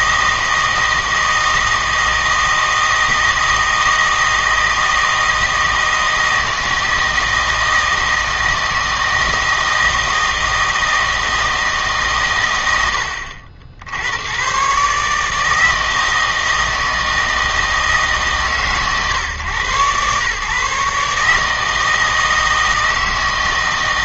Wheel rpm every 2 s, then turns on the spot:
160, 160, 160, 160, 160, 160, 100, 140, 160, 130, 140, 160.
none